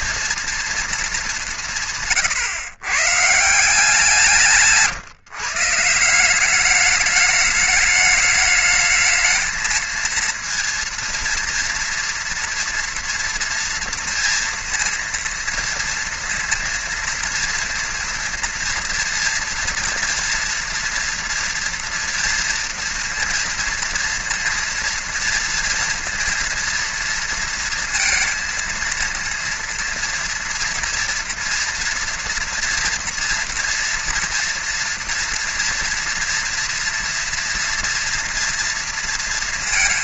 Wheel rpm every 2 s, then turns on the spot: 230, 130, 150, 200, 210, 230, 230, 230, 230, 230, 240, 230, 230, 230, 230, 230, 230, 240, 230, 230.
4-6